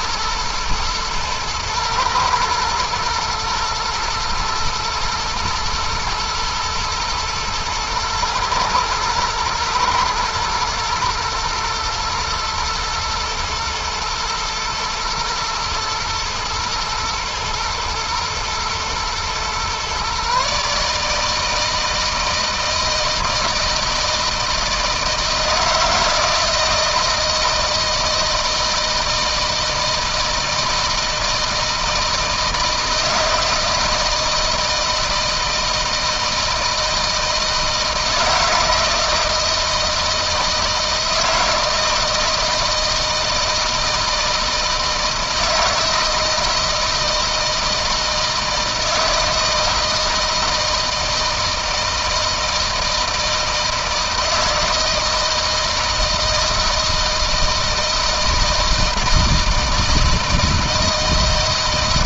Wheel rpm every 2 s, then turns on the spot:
110, 110, 110, 110, 110, 110, 110, 110, 110, 110, 140, 160, 160, 160, 160, 160, 160, 160, 160, 160, 160, 170, 160, 160, 160, 160, 160, 160, 160, 160, 160.
none